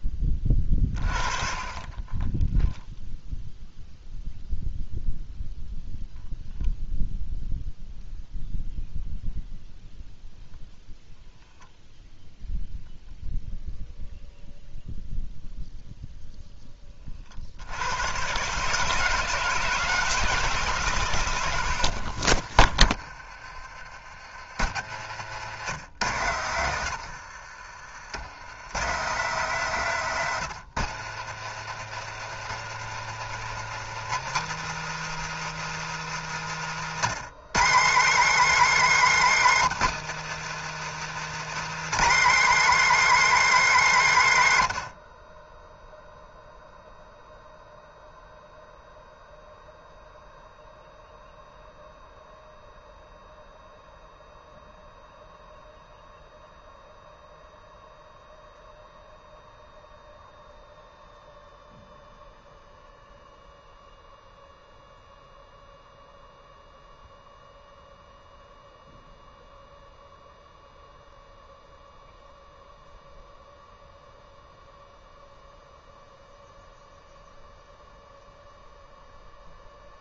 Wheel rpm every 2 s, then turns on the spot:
30, 0, 0, 0, 0, 0, 0, 0, 20, 150, 140, 40, 80, 80, 130, 110, 120, 160, 150, 270, 160, 300, 120, 0, 0, 0, 0, 0, 0, 0, 0, 0, 0, 0, 0, 0, 0, 0, 0, 0.
22-24 36-38